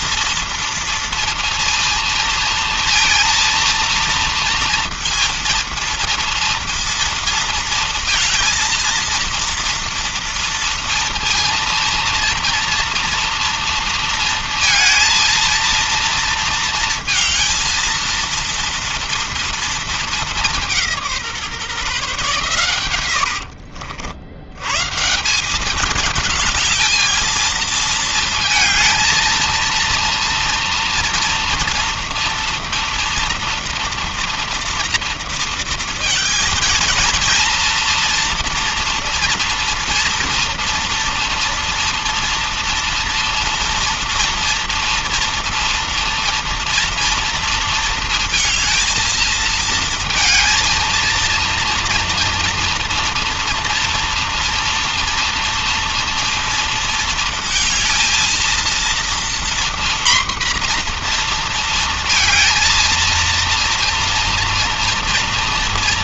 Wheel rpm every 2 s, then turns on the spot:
230, 230, 230, 230, 230, 230, 230, 230, 230, 230, 200, 130, 110, 210, 220, 230, 230, 230, 220, 240, 230, 230, 230, 230, 220, 230, 230, 240, 230, 230, 240, 230, 230.
none